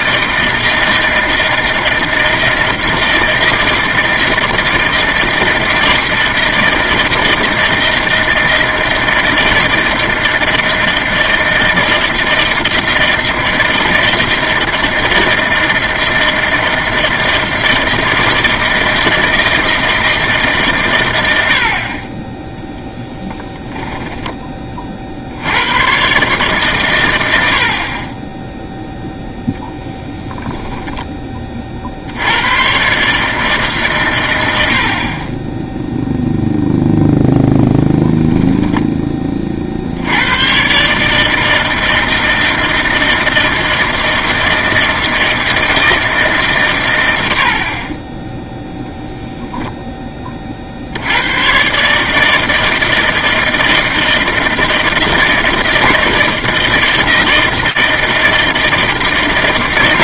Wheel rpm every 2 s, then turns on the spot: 160, 160, 160, 160, 160, 160, 160, 160, 160, 160, 130, 10, 40, 130, 0, 10, 130, 60, 0, 20, 140, 160, 160, 120, 10, 60, 160, 160, 160, 160.
none